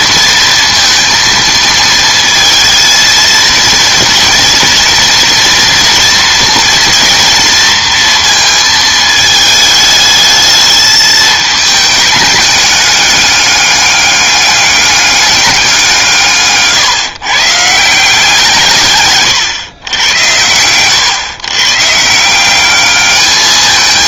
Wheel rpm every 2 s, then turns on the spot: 230, 230, 230, 230, 220, 210, 210, 200, 140, 160, 100, 180.
16-18